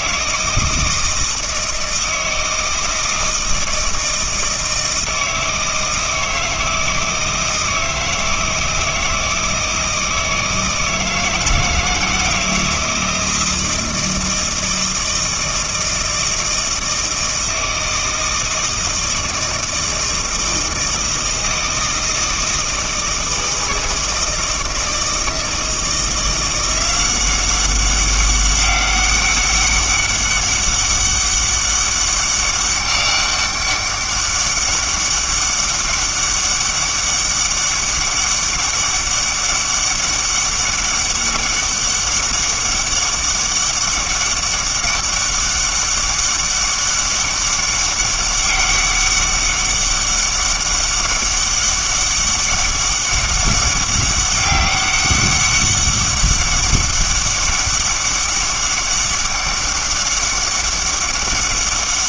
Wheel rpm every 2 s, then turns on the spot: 160, 160, 160, 160, 160, 160, 160, 160, 160, 160, 160, 160, 160, 180, 190, 200, 200, 200, 200, 200, 200, 200, 200, 200, 200, 200, 200, 200, 200, 200, 200.
none